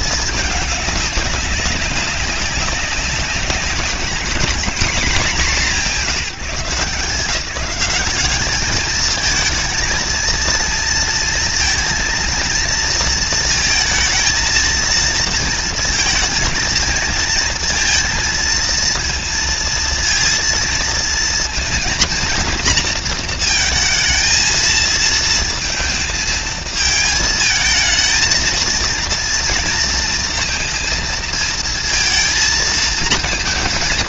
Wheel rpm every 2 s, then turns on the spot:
220, 200, 190, 200, 180, 220, 230, 230, 230, 230, 230, 230, 230, 230, 220, 230, 230.
none